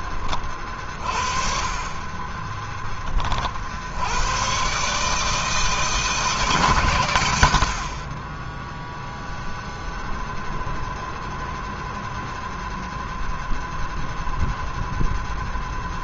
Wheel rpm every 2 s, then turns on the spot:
40, 30, 150, 90, 0, 0, 0, 10.
none